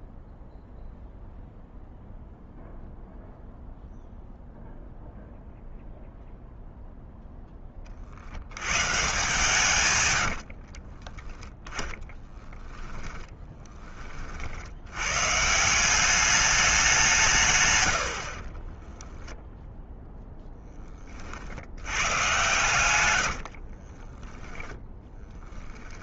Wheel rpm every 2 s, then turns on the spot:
0, 0, 0, 0, 130, 40, 10, 90, 200, 30, 20, 120, 10.
10-12 18-20 22-24